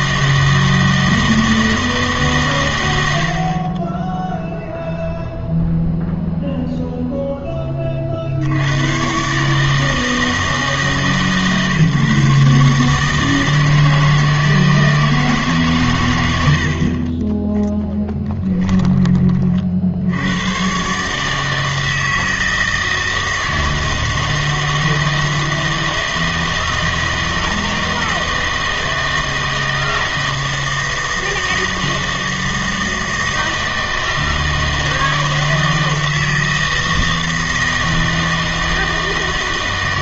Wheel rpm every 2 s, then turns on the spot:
160, 120, 0, 0, 90, 160, 150, 160, 60, 10, 110, 160, 160, 160, 160, 160, 160, 160, 160, 160.
none